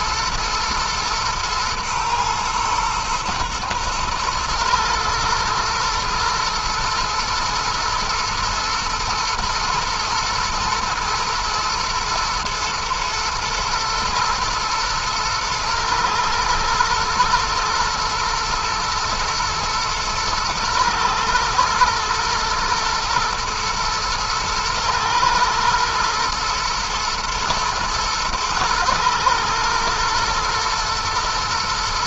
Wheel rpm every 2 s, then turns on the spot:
110, 120, 110, 110, 110, 120, 110, 110, 120, 110, 110, 110, 120, 120, 110, 120.
none